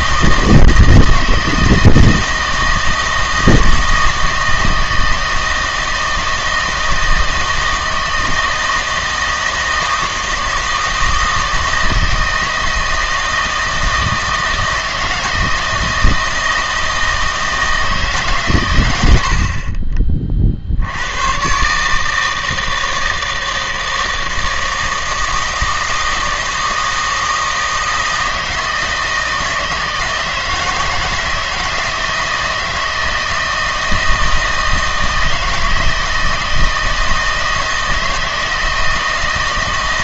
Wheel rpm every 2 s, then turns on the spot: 160, 160, 160, 160, 160, 160, 160, 160, 160, 120, 60, 160, 160, 160, 160, 160, 160, 160, 160, 160.
none